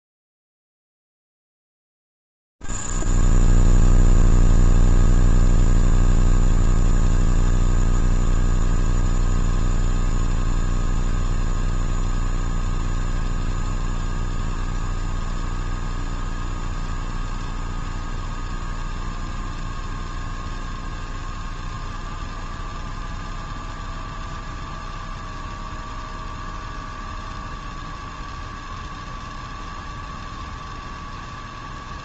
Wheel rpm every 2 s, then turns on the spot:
0, 0, 0, 0, 0, 0, 0, 0, 0, 0, 0, 0, 0, 0, 0, 0.
none